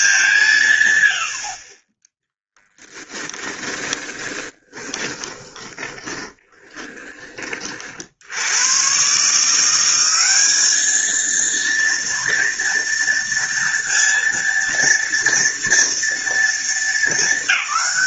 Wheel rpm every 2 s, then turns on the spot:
170, 10, 20, 10, 90, 210, 230, 230, 230.
2-8